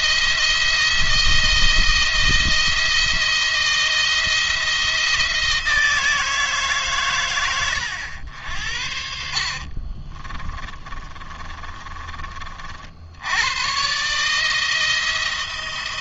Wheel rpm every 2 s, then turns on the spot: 170, 170, 170, 140, 80, 30, 70, 160.
8-12